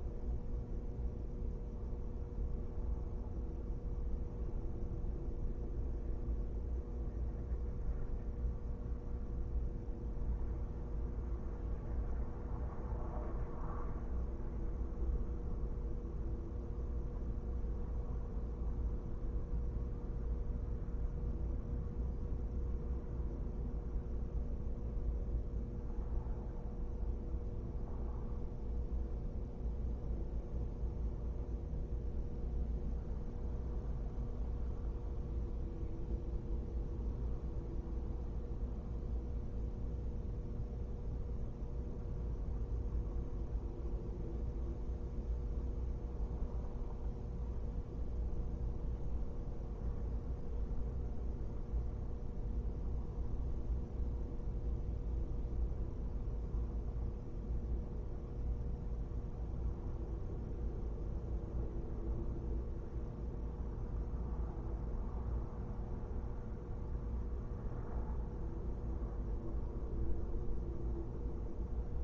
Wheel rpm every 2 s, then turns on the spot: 0, 0, 0, 0, 0, 0, 0, 0, 0, 0, 0, 0, 0, 0, 0, 0, 0, 0, 0, 0, 0, 0, 0, 0, 0, 0, 0, 0, 0, 0, 0, 0, 0, 0, 0, 0.
none